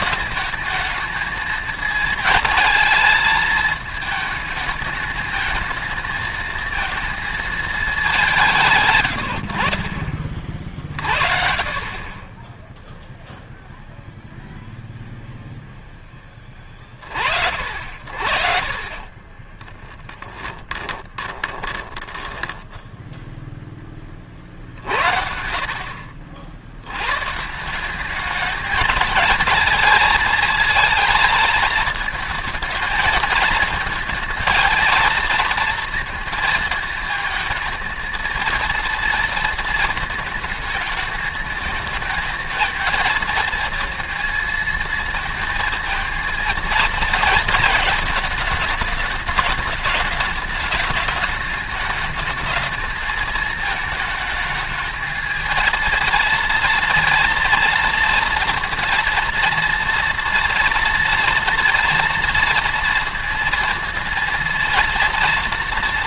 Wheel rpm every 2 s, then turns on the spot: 220, 220, 210, 220, 170, 50, 10, 0, 20, 50, 20, 10, 50, 80, 210, 230, 230, 230, 220, 230, 220, 220, 230, 230, 220, 210, 220, 220, 230, 230, 240, 230, 230.
18-26